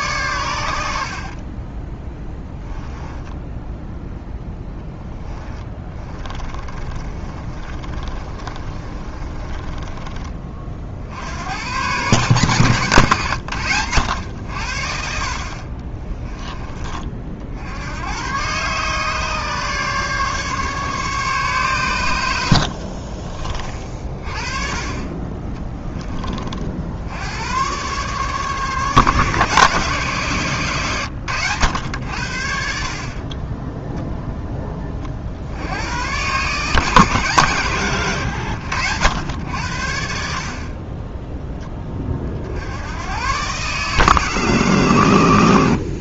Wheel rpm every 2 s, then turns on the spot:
70, 10, 10, 30, 30, 50, 120, 60, 30, 140, 140, 50, 30, 80, 150, 120, 60, 40, 160, 100, 20, 90, 130.
0-10 22-24